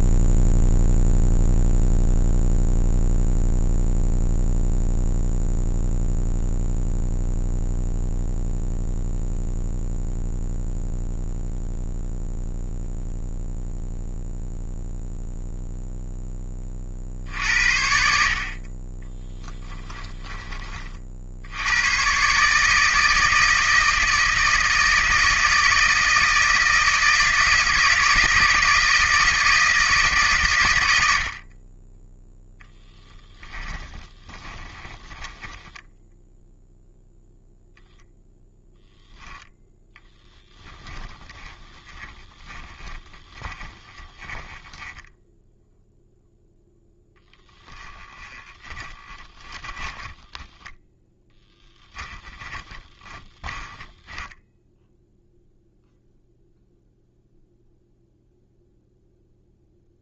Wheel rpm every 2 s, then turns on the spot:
0, 0, 0, 0, 0, 0, 0, 0, 40, 20, 40, 150, 160, 160, 160, 100, 0, 20, 0, 0, 10, 10, 10, 0, 20, 10, 20, 0, 0, 0.
34-36 42-46 48-54